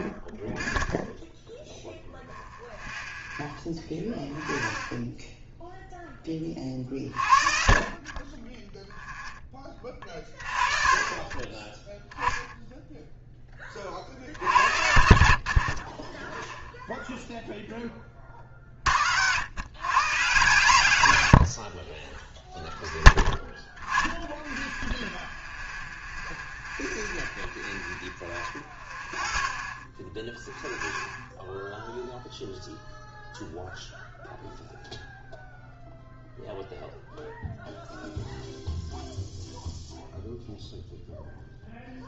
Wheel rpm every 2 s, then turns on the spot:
0, 0, 0, 30, 10, 30, 10, 70, 0, 50, 130, 0, 0, 0, 0, 0, 0, 0, 0, 0, 0.
none